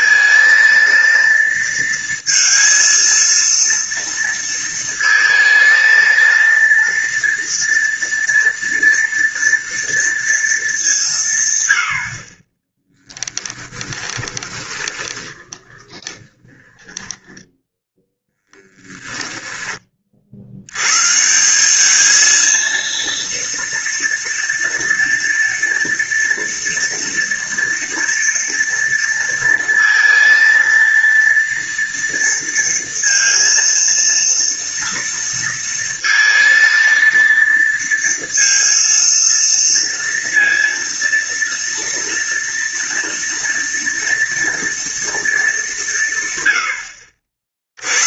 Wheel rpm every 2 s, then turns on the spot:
230, 230, 230, 230, 230, 190, 10, 20, 10, 10, 120, 230, 230, 230, 230, 230, 230, 230, 230, 230, 230, 230, 230, 80.
14-20